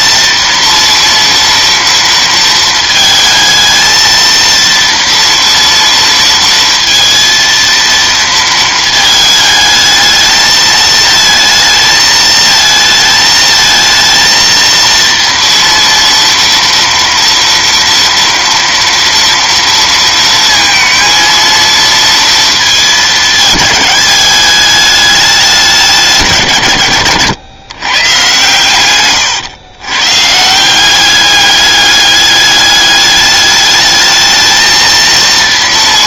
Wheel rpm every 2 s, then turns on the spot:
230, 220, 230, 230, 220, 220, 220, 230, 230, 230, 230, 220, 210, 110, 120, 200, 210, 230.
28-30